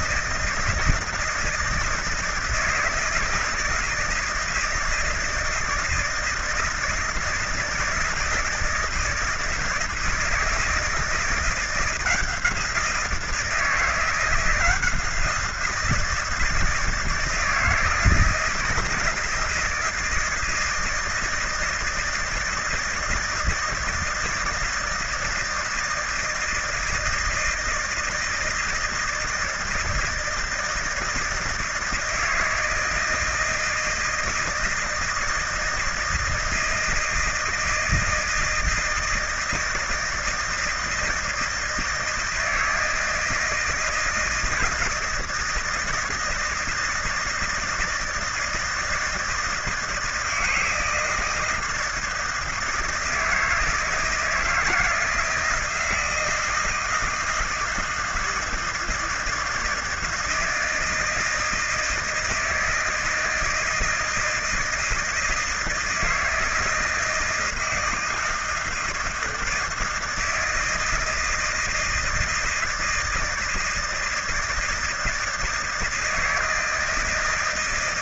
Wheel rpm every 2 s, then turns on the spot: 160, 160, 160, 160, 160, 160, 170, 170, 160, 170, 160, 160, 160, 160, 160, 170, 160, 160, 160, 160, 160, 160, 170, 160, 160, 160, 160, 160, 160, 160, 160, 160, 160, 160, 160, 160, 160, 160, 160.
none